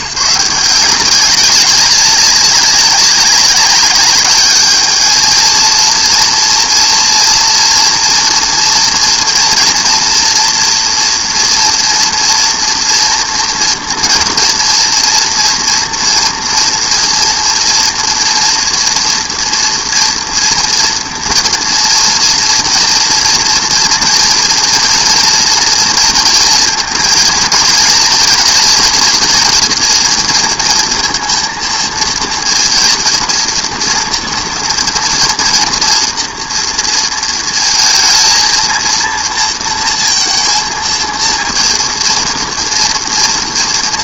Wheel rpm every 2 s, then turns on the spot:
170, 190, 210, 230, 230, 230, 230, 230, 230, 230, 230, 230, 240, 230, 230, 230, 230, 240, 230, 230, 230, 230.
none